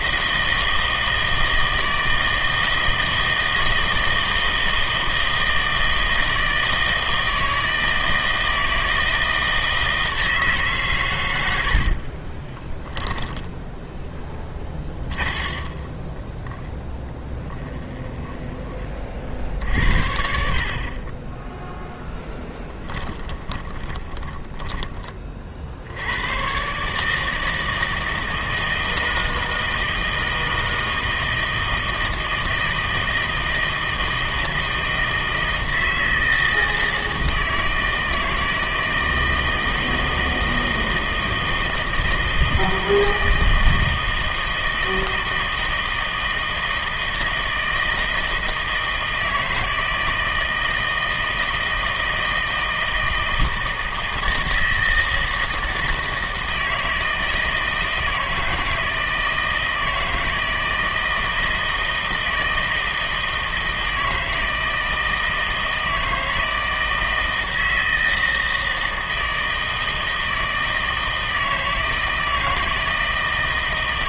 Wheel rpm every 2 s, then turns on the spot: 160, 160, 160, 160, 160, 140, 10, 20, 10, 20, 40, 20, 10, 140, 160, 160, 160, 160, 160, 160, 160, 160, 160, 160, 160, 160, 160, 160, 160, 160, 160, 160, 160, 160, 160, 160, 160.
12-18 22-24